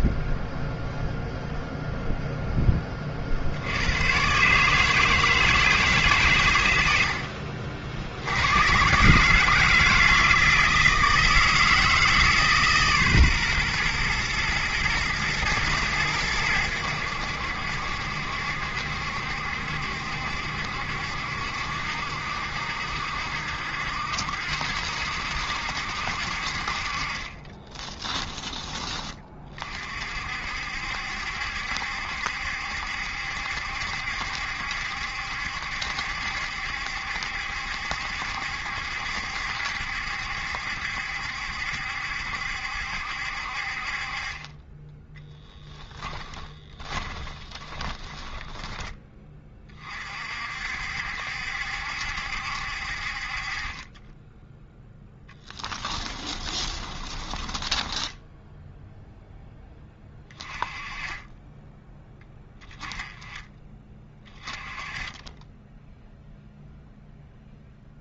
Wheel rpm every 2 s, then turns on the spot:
0, 30, 160, 90, 130, 160, 140, 110, 80, 70, 70, 60, 70, 40, 20, 60, 70, 70, 70, 70, 70, 70, 20, 20, 10, 60, 60, 10, 20, 0, 20, 20, 20, 0.
46-48 56-58